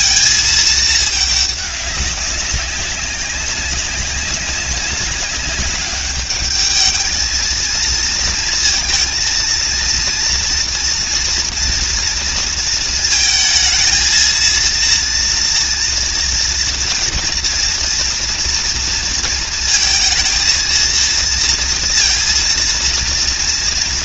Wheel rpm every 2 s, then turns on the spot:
220, 200, 200, 210, 230, 230, 220, 230, 240, 230, 230, 230.
none